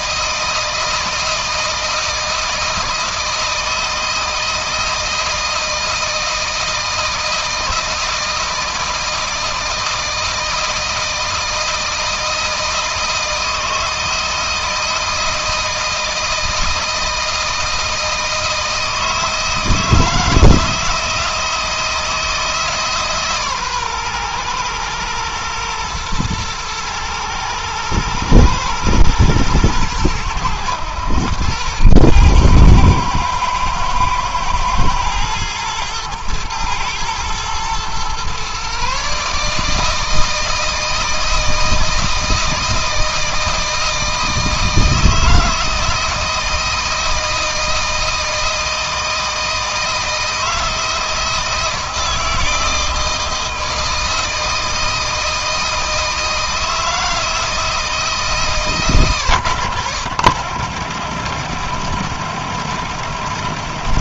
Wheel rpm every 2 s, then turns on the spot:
160, 160, 160, 160, 160, 160, 160, 160, 160, 160, 160, 150, 120, 110, 110, 100, 110, 120, 110, 130, 160, 160, 160, 160, 160, 160, 160, 160, 160, 140, 90, 80.
none